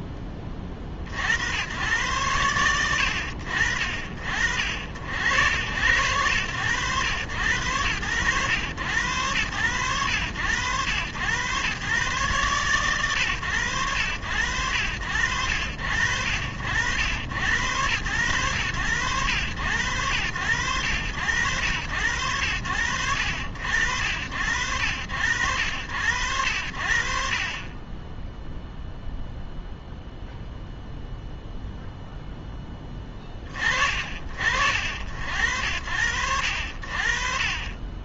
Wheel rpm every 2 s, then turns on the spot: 10, 120, 50, 100, 90, 90, 130, 80, 70, 100, 90, 80, 60, 70, 0, 0, 0, 50, 60.
none